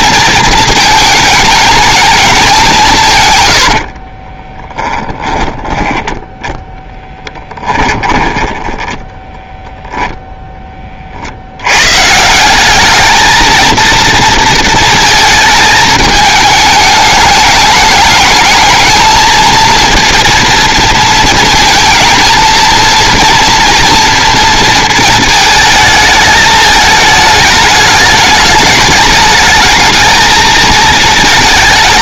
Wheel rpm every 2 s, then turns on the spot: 220, 180, 10, 10, 10, 20, 200, 220, 210, 220, 230, 230, 230, 220, 210, 220.
4-10